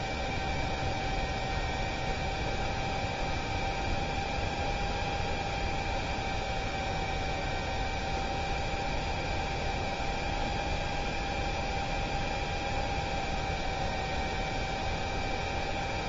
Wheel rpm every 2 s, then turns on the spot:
0, 0, 0, 0, 0, 0, 0, 0.
none